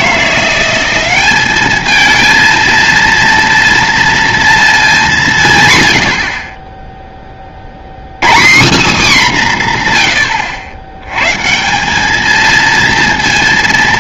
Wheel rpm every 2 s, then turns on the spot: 170, 220, 230, 40, 150, 110, 210.
none